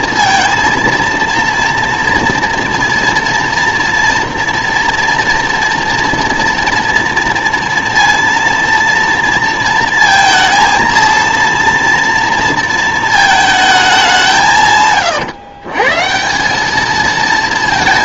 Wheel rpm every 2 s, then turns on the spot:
230, 230, 240, 230, 230, 230, 230, 140, 200.
none